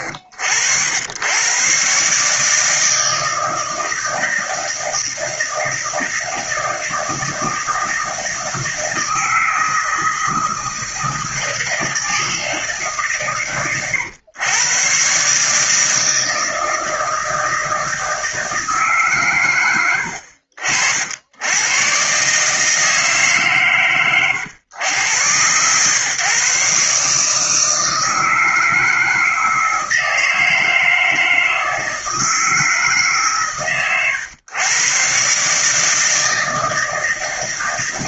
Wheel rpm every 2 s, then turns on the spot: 90, 160, 160, 160, 160, 160, 140, 140, 160, 120, 80, 150, 100, 150, 160, 160, 150, 130, 160.
none